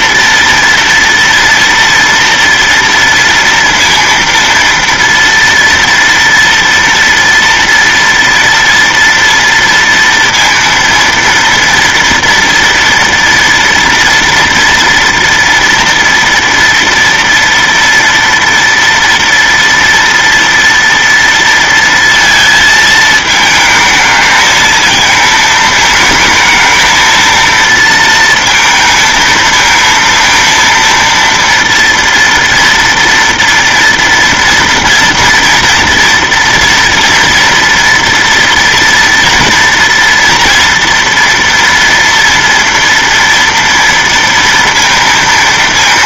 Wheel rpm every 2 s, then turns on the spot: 230, 230, 230, 230, 230, 230, 230, 230, 230, 230, 230, 220, 220, 220, 220, 230, 240, 230, 230, 240, 230, 230, 230.
none